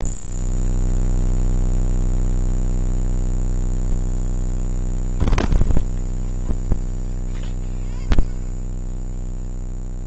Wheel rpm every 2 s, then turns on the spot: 0, 0, 0, 10, 20.
none